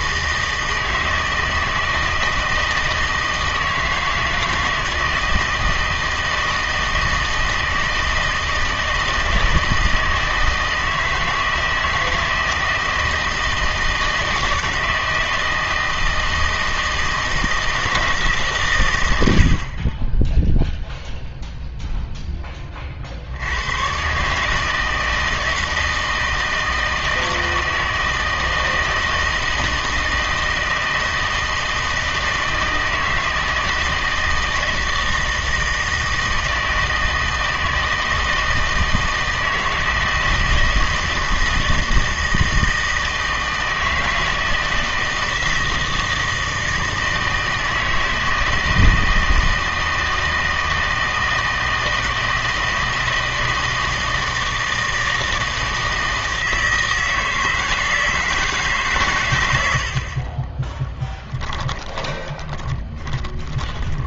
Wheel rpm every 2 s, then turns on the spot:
160, 160, 160, 160, 160, 160, 160, 160, 160, 130, 0, 40, 160, 160, 160, 160, 160, 160, 160, 160, 160, 160, 160, 160, 160, 160, 160, 160, 160, 150, 20, 20.
60-64